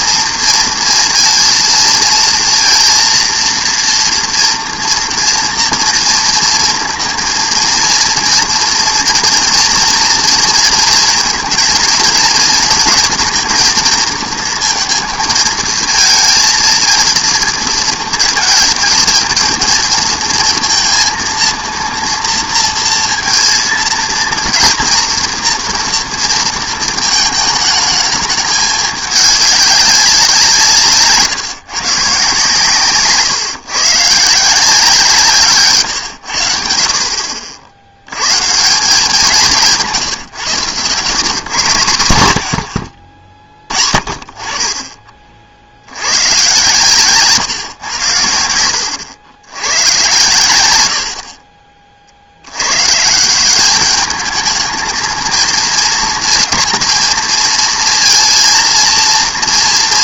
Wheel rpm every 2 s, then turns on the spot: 230, 230, 230, 230, 240, 230, 230, 230, 230, 220, 230, 230, 230, 230, 210, 170, 140, 160, 70, 150, 130, 80, 30, 130, 90, 90, 100, 220, 230, 230.
none